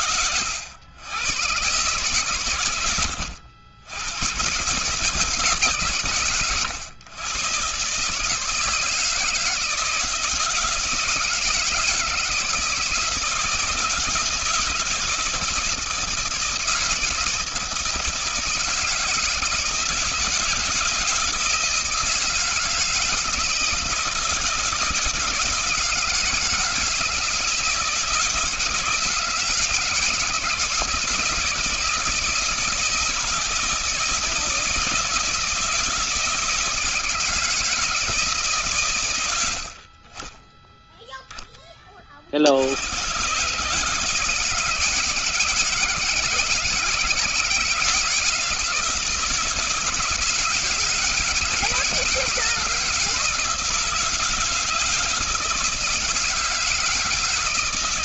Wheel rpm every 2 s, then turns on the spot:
100, 110, 140, 110, 160, 170, 160, 160, 160, 170, 160, 160, 160, 160, 170, 170, 160, 160, 160, 130, 10, 100, 160, 160, 160, 160, 170, 160, 160.
none